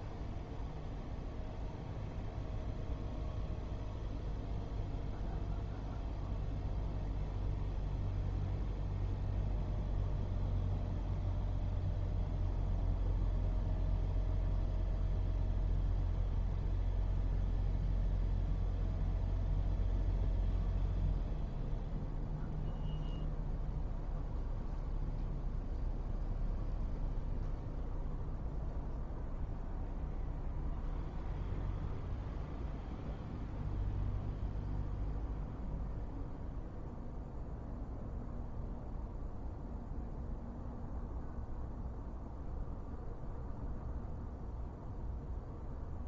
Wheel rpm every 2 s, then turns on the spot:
0, 0, 0, 0, 0, 0, 0, 0, 0, 0, 0, 0, 0, 0, 0, 0, 0, 0, 0, 0, 0, 0, 0.
none